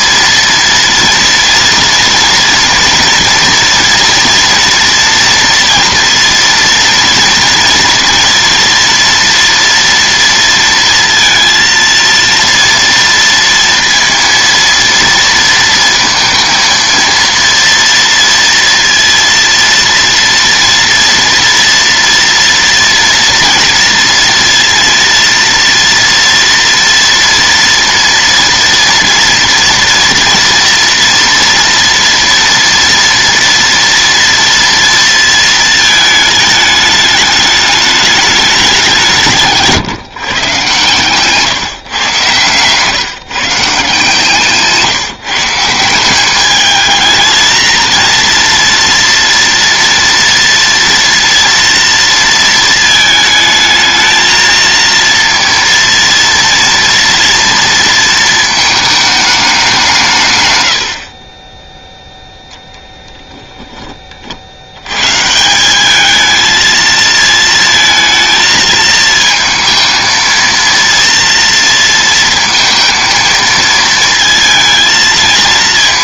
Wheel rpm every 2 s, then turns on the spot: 230, 230, 230, 230, 230, 230, 230, 230, 230, 230, 230, 230, 230, 230, 230, 230, 240, 230, 210, 190, 130, 130, 150, 210, 230, 230, 220, 230, 230, 220, 100, 0, 90, 220, 220, 230, 230, 220.
none